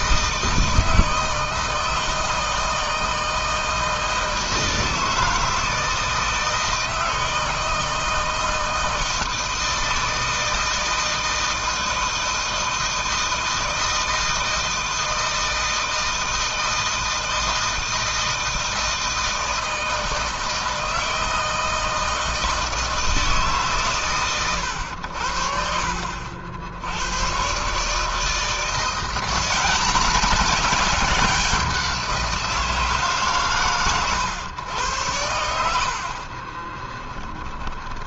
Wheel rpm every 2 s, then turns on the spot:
160, 160, 160, 160, 160, 160, 160, 160, 160, 160, 160, 160, 80, 110, 180, 190, 140, 90, 20.
36-38